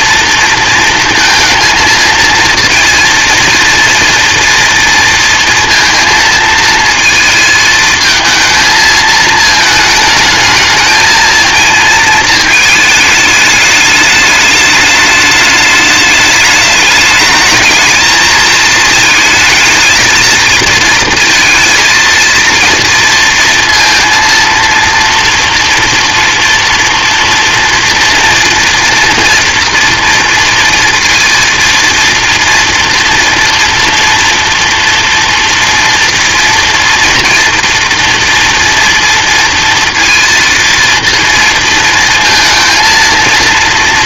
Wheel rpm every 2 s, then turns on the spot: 230, 230, 230, 220, 220, 220, 220, 210, 210, 230, 230, 230, 230, 230, 230, 230, 230, 230, 230, 230, 230, 230.
none